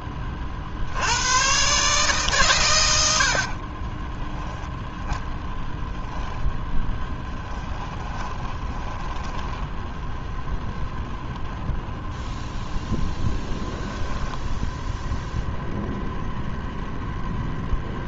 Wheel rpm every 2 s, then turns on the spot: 70, 90, 10, 10, 10, 0, 0, 0, 0.
2-4 6-10